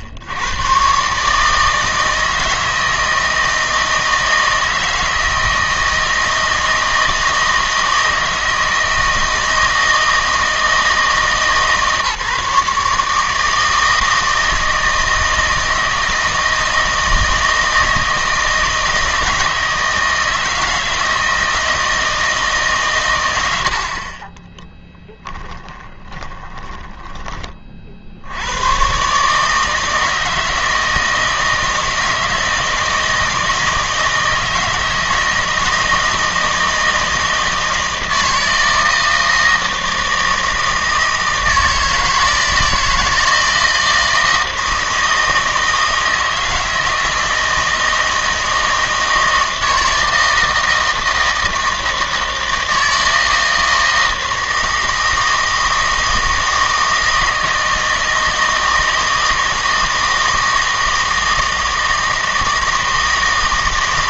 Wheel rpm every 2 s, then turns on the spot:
90, 160, 160, 160, 160, 160, 150, 160, 160, 160, 160, 150, 10, 20, 110, 160, 160, 160, 160, 160, 160, 160, 160, 160, 160, 160, 160, 160, 160, 160, 160, 160.
24-28